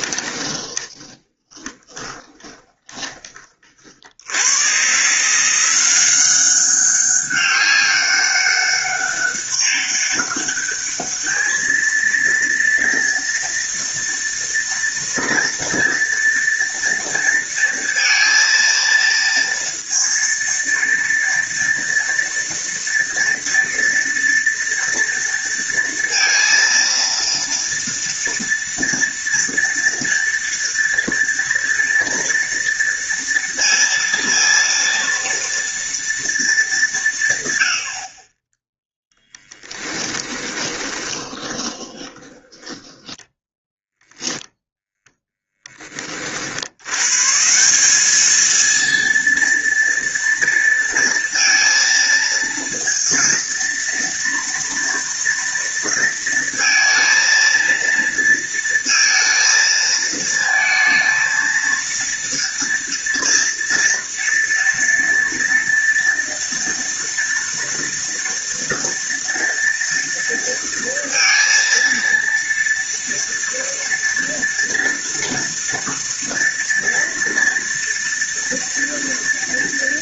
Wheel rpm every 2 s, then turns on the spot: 20, 20, 130, 190, 200, 210, 230, 230, 230, 230, 230, 230, 230, 230, 230, 230, 230, 230, 190, 0, 20, 10, 0, 110, 230, 230, 230, 230, 230, 230, 220, 230, 230, 230, 230, 230, 230, 230, 230, 230.
0-4 40-44